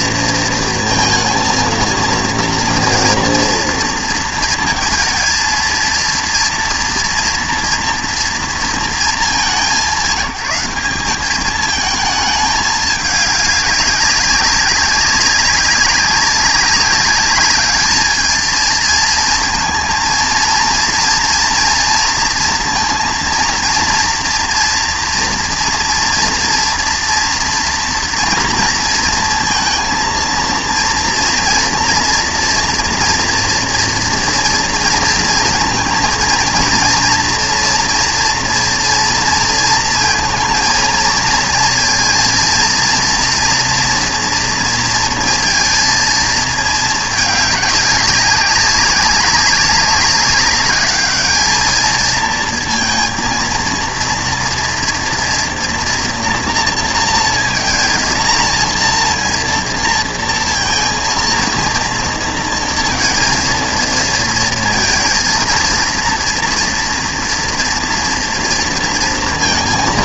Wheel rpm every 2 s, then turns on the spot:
230, 230, 230, 230, 240, 190, 210, 200, 200, 220, 230, 230, 230, 230, 230, 230, 240, 230, 230, 230, 230, 230, 230, 220, 200, 200, 220, 230, 230, 230, 230, 230, 220, 230, 230.
none